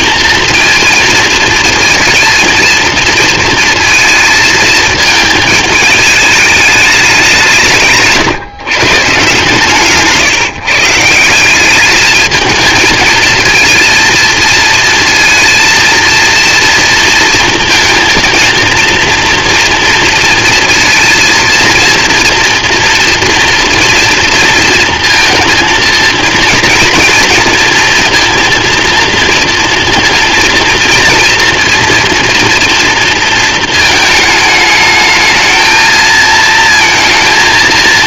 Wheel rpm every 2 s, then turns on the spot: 230, 230, 220, 210, 140, 150, 220, 230, 230, 230, 230, 240, 230, 230, 230, 230, 240, 210, 230.
none